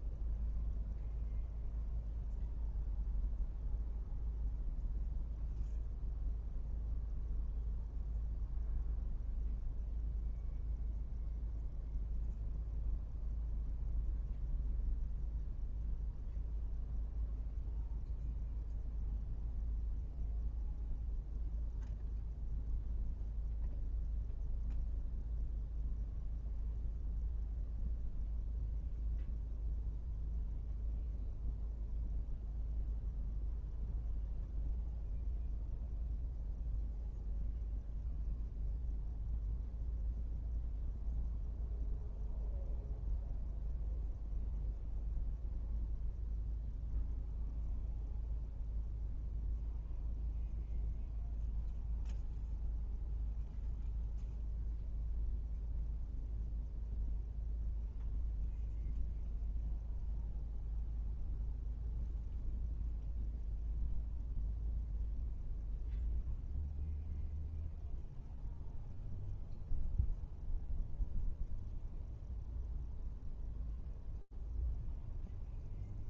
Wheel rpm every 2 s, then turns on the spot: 0, 0, 0, 0, 0, 0, 0, 0, 0, 0, 0, 0, 0, 0, 0, 0, 0, 0, 0, 0, 0, 0, 0, 0, 0, 0, 0, 0, 0, 0, 0, 0, 0, 0, 0, 0, 0, 0.
none